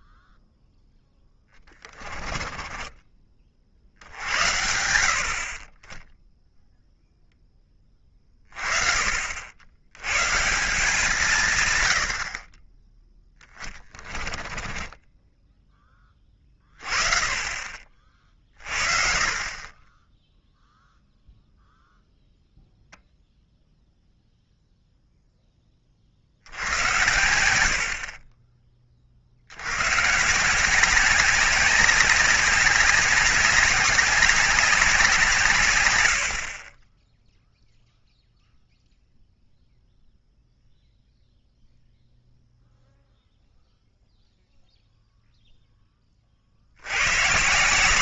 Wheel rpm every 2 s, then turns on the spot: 10, 20, 70, 0, 20, 160, 10, 20, 30, 50, 0, 0, 0, 90, 30, 170, 190, 190, 30, 0, 0, 0, 0, 80.
2-4 14-16